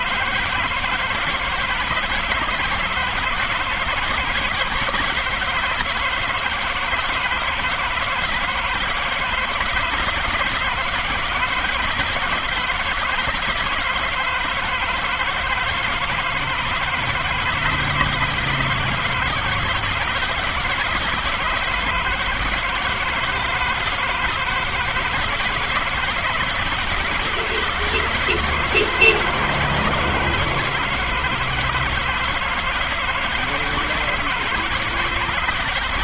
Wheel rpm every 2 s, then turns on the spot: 160, 160, 160, 160, 160, 160, 160, 160, 160, 160, 150, 160, 160, 160, 160, 160, 160, 160.
none